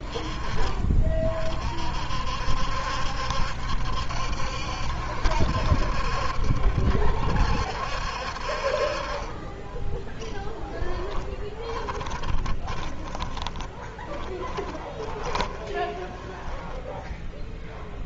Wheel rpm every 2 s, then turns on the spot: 30, 70, 60, 70, 50, 10, 20, 20, 10.
10-18